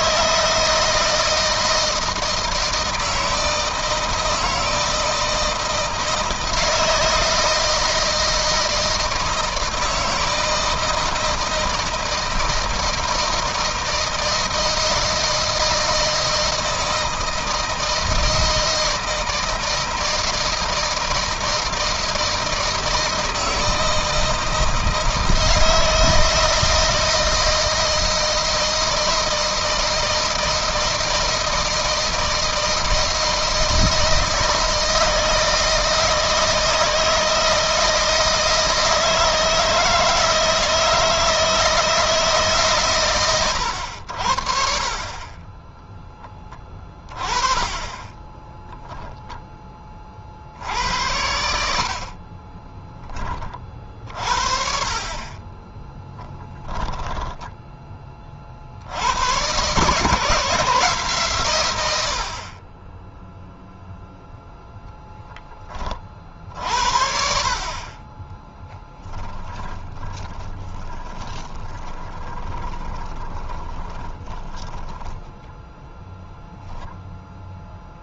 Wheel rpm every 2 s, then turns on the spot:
160, 160, 160, 160, 160, 160, 160, 160, 160, 160, 160, 160, 160, 160, 160, 160, 160, 160, 160, 160, 160, 120, 30, 30, 0, 80, 20, 40, 10, 90, 150, 20, 10, 60, 20, 20, 20, 10, 0.
56-58 68-76